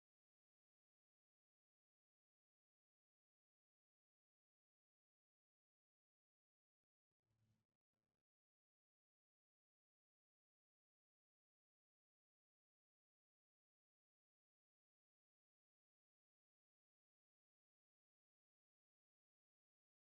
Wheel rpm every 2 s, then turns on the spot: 0, 0, 0, 0, 0, 0, 0, 0, 0, 0.
none